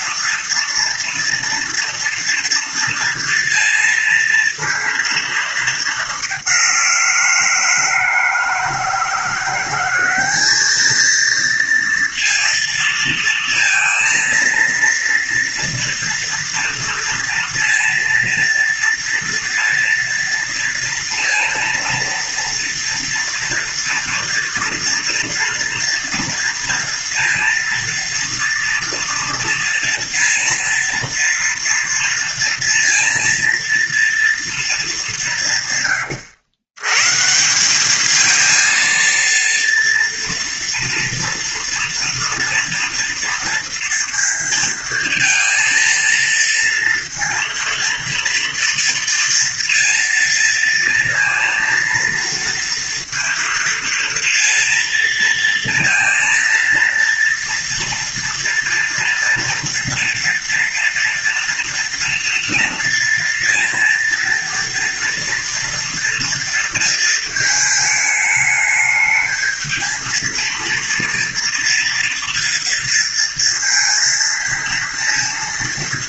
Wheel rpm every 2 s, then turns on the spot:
230, 230, 230, 180, 170, 220, 230, 230, 230, 230, 230, 230, 240, 230, 230, 230, 230, 210, 120, 230, 230, 230, 230, 230, 230, 230, 230, 230, 230, 230, 230, 230, 230, 230, 210, 230, 230, 230.
none